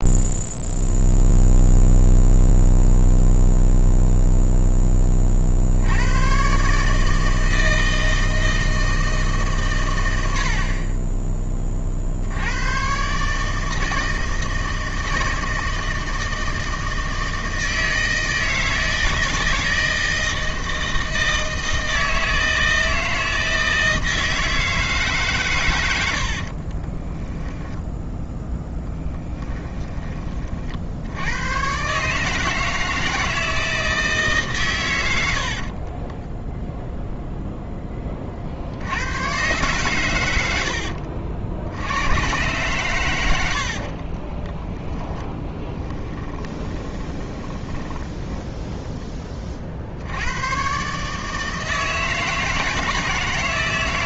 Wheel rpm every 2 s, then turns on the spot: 0, 0, 0, 140, 160, 30, 110, 160, 160, 160, 160, 160, 160, 40, 0, 50, 160, 130, 0, 80, 80, 120, 10, 20, 10, 130, 160.
26-28 44-48